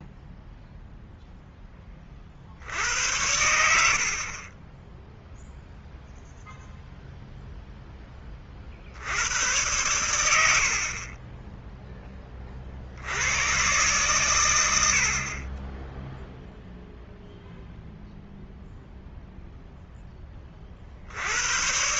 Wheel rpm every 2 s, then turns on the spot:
0, 70, 20, 0, 50, 60, 40, 90, 0, 0, 40.
none